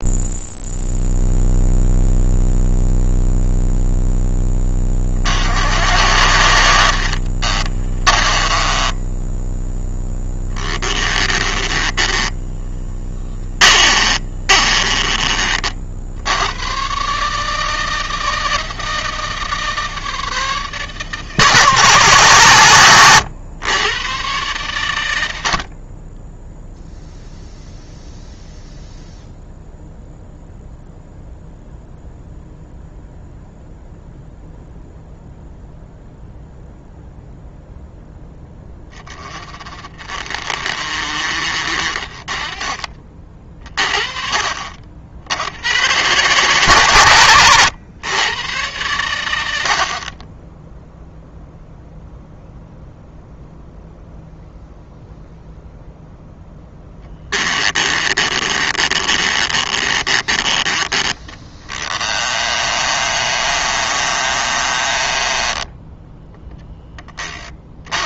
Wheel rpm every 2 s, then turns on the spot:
0, 0, 40, 40, 10, 20, 30, 30, 140, 160, 160, 120, 110, 0, 0, 0, 0, 0, 0, 20, 50, 30, 60, 130, 100, 0, 0, 0, 10, 30, 20, 30, 20, 20.
6-16 56-66